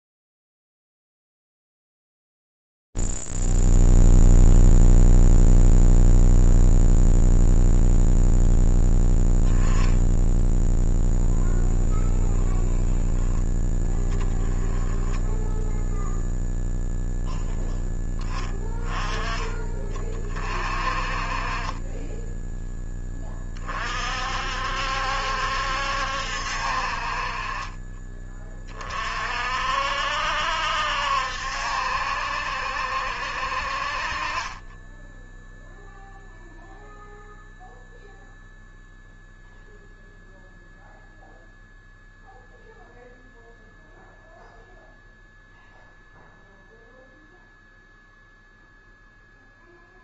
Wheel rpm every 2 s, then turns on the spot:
0, 0, 0, 0, 0, 0, 20, 10, 0, 10, 30, 10, 60, 50, 30, 70, 50, 10, 0, 0, 0, 0, 0, 0, 0.
12-14